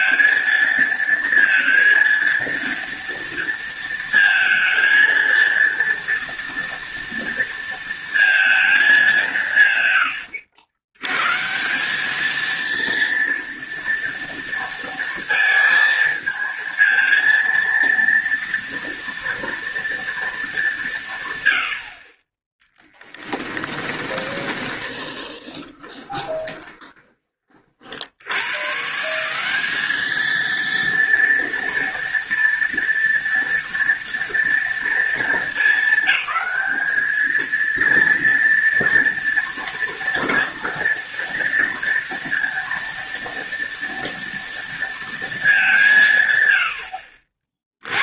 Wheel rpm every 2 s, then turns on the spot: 230, 230, 230, 230, 230, 100, 220, 230, 220, 230, 220, 20, 20, 20, 90, 220, 240, 230, 220, 230, 230, 230, 230, 120.
24-28